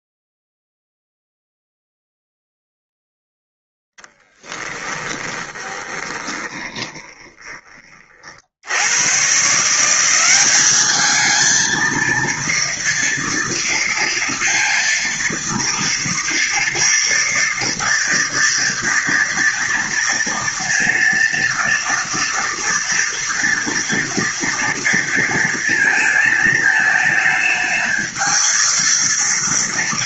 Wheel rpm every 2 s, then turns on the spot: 0, 0, 10, 20, 80, 200, 230, 230, 230, 230, 230, 240, 230, 220, 230.
4-8